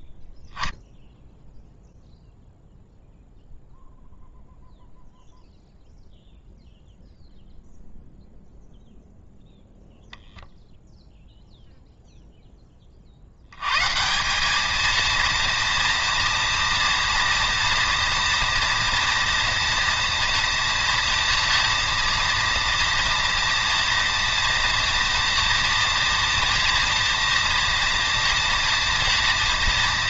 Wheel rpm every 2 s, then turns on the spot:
0, 0, 0, 0, 0, 80, 230, 230, 230, 230, 230, 230, 230, 230, 230.
none